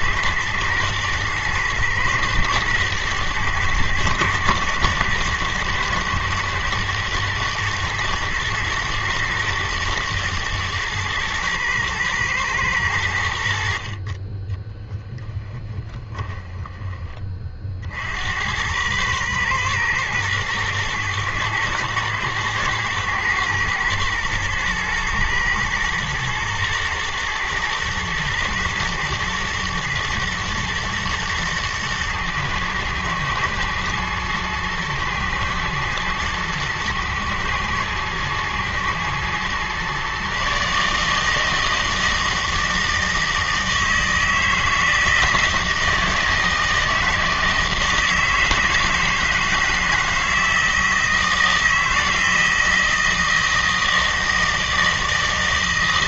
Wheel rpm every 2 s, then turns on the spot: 120, 110, 110, 110, 110, 110, 100, 10, 20, 100, 110, 110, 120, 120, 120, 120, 110, 120, 110, 110, 150, 160, 160, 160, 160, 160, 160, 160.
14-16